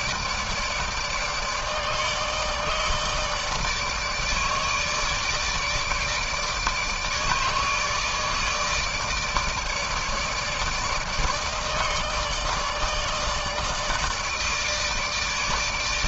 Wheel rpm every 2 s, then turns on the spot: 150, 150, 150, 150, 150, 150, 150, 150.
none